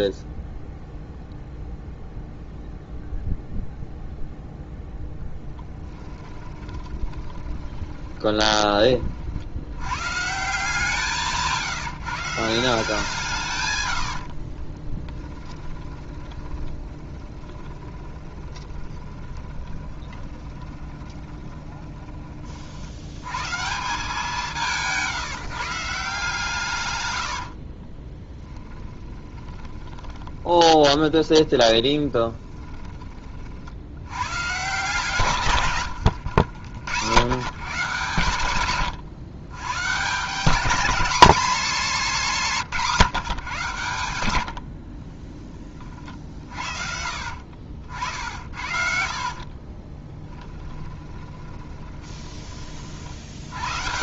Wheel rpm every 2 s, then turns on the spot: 0, 0, 0, 20, 20, 160, 170, 30, 20, 10, 20, 40, 170, 140, 10, 20, 20, 140, 90, 130, 200, 170, 60, 40, 50, 10, 30.
6-10 14-22 28-34 38-40 50-52